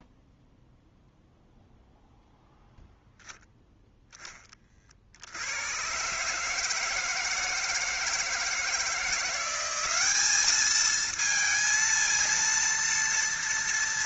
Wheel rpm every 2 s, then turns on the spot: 0, 0, 50, 160, 170, 220, 230.
none